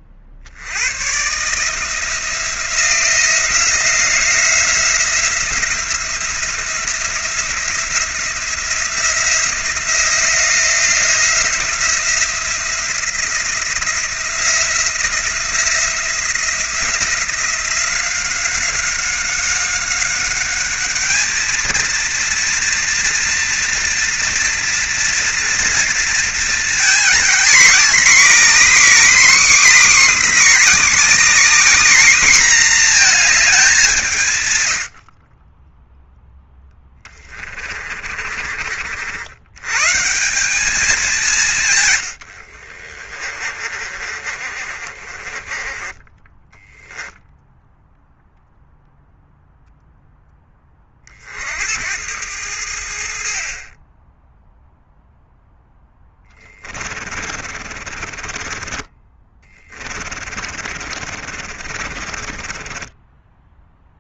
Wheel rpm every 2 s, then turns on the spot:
100, 170, 170, 170, 170, 170, 170, 170, 170, 190, 210, 230, 230, 240, 290, 280, 240, 100, 10, 60, 200, 50, 40, 10, 0, 30, 80, 0, 50, 30, 40, 30.
34-38 42-48 56-64